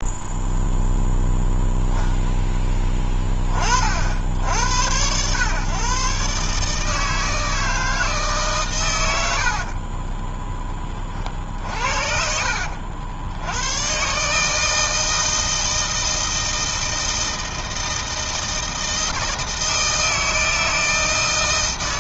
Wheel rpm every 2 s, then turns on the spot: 0, 10, 90, 150, 120, 20, 60, 160, 160, 160, 160.
none